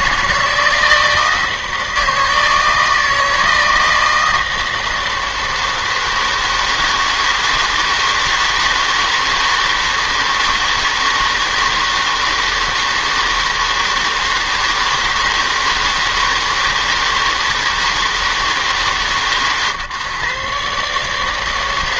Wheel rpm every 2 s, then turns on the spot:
160, 160, 160, 160, 160, 160, 160, 160, 160, 150, 140.
none